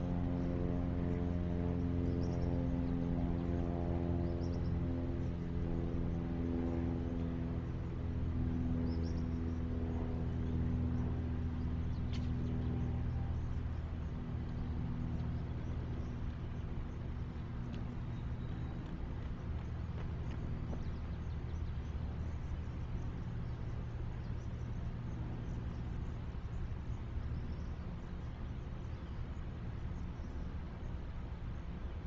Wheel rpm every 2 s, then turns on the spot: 0, 0, 0, 0, 0, 0, 0, 0, 0, 0, 0, 0, 0, 0, 0, 0.
none